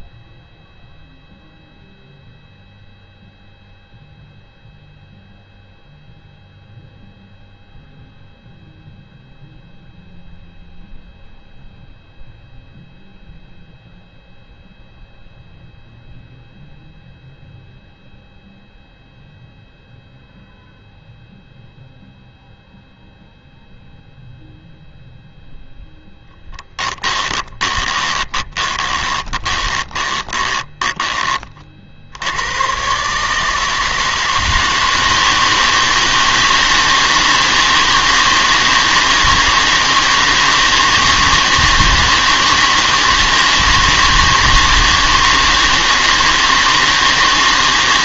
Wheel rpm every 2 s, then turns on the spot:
0, 0, 0, 0, 0, 0, 0, 0, 0, 0, 0, 0, 0, 10, 20, 10, 130, 160, 160, 160, 160, 160, 160, 150.
26-30